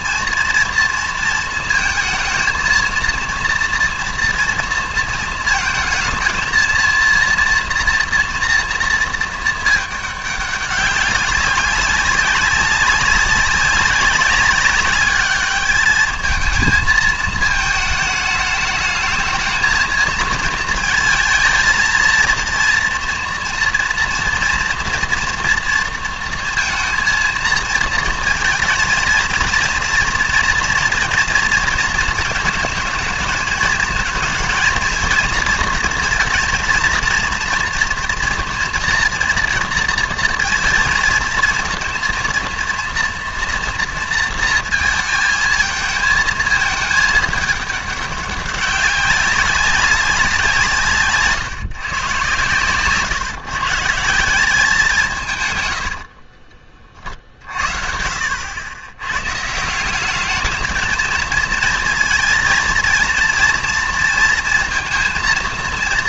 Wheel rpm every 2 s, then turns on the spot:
230, 230, 230, 230, 230, 200, 200, 200, 220, 210, 230, 230, 240, 230, 230, 230, 230, 230, 230, 230, 230, 230, 230, 220, 200, 160, 130, 180, 40, 80, 220, 230, 230.
none